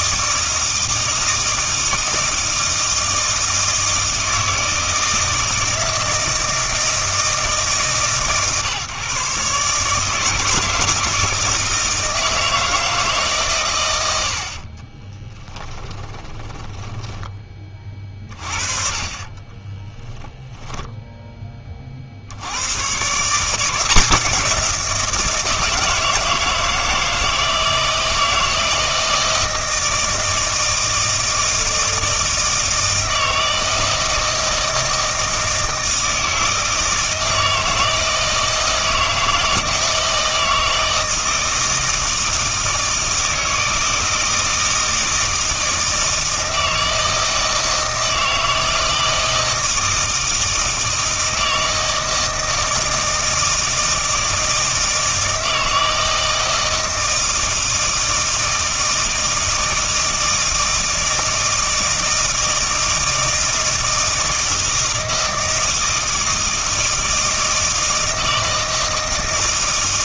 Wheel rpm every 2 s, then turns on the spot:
160, 160, 160, 160, 140, 160, 160, 40, 10, 40, 0, 120, 170, 160, 160, 160, 160, 160, 160, 160, 160, 160, 160, 160, 160, 160, 160, 160, 160, 160, 160, 160, 160, 160, 160.
14-18